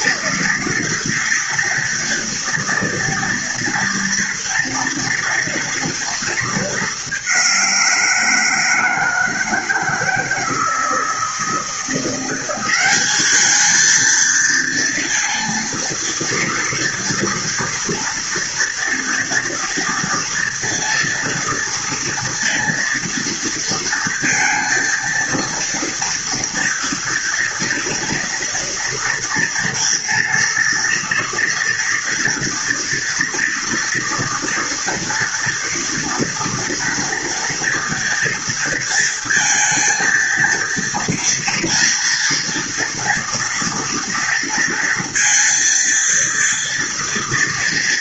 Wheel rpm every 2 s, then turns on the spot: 230, 230, 230, 210, 160, 160, 190, 230, 230, 230, 230, 230, 230, 230, 240, 230, 230, 230, 230, 230, 230, 230, 230, 230.
none